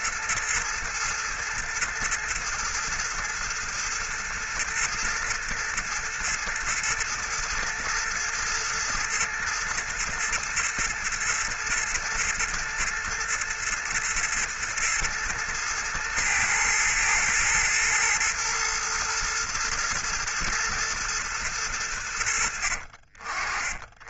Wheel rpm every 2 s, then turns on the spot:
110, 110, 110, 110, 120, 120, 110, 110, 110, 110, 120, 50.
none